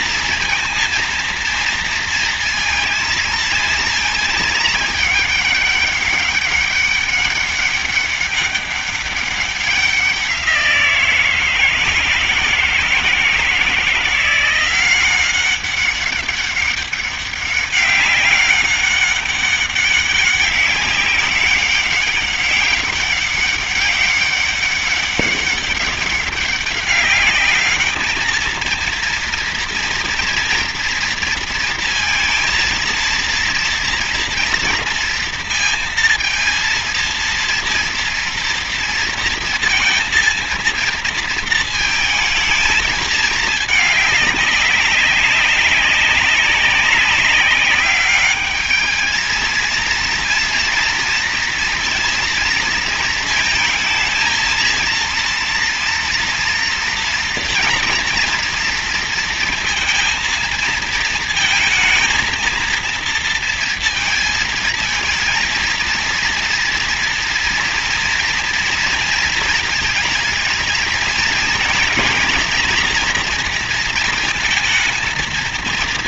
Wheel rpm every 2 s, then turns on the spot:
230, 230, 210, 200, 200, 170, 160, 190, 200, 200, 200, 200, 200, 200, 230, 240, 230, 230, 230, 230, 230, 220, 200, 190, 220, 230, 230, 230, 240, 230, 230, 230, 220, 230, 230, 230, 230, 230.
none